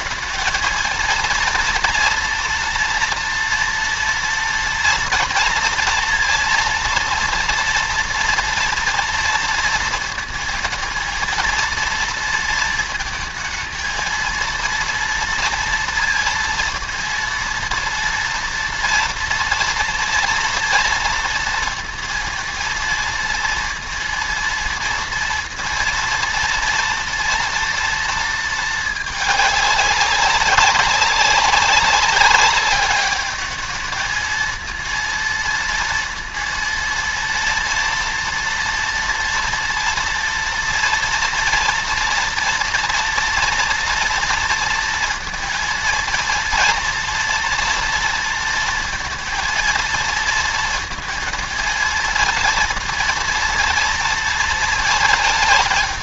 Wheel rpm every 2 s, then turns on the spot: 230, 230, 230, 230, 230, 230, 230, 230, 230, 230, 230, 230, 230, 230, 220, 190, 200, 230, 230, 230, 230, 230, 230, 230, 230, 230, 230, 220.
none